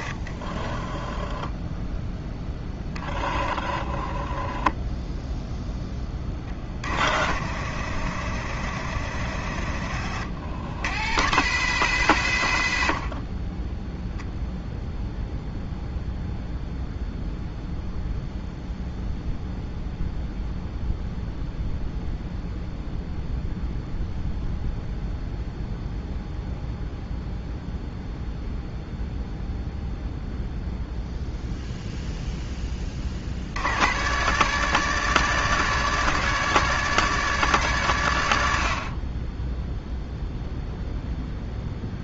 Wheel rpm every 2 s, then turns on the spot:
20, 10, 0, 30, 80, 80, 90, 0, 0, 0, 0, 0, 0, 0, 0, 0, 10, 130, 130, 60, 0.
0-2